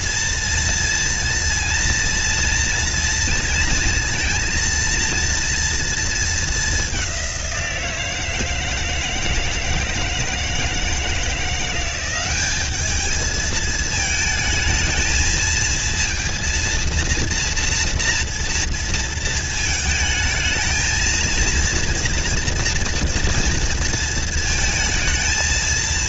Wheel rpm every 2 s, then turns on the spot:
230, 230, 230, 220, 160, 160, 200, 220, 230, 230, 220, 240, 220.
none